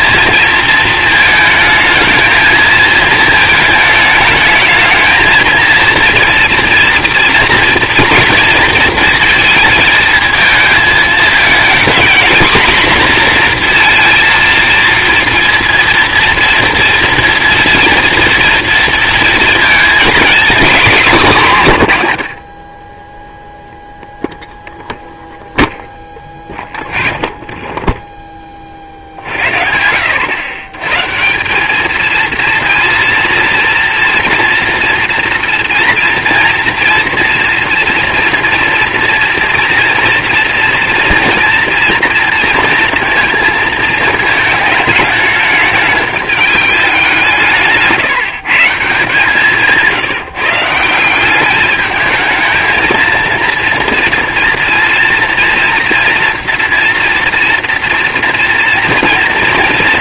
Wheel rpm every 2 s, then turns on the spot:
220, 220, 220, 230, 230, 220, 240, 230, 230, 230, 220, 10, 0, 20, 70, 160, 230, 240, 230, 230, 230, 230, 210, 190, 150, 180, 230, 230, 230, 230.
none